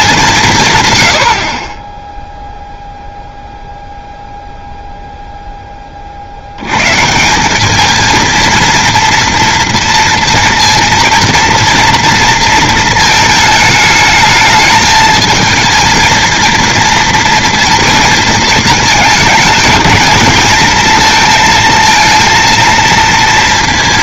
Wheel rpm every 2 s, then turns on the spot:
160, 0, 0, 100, 230, 230, 220, 220, 230, 220, 230, 230.
none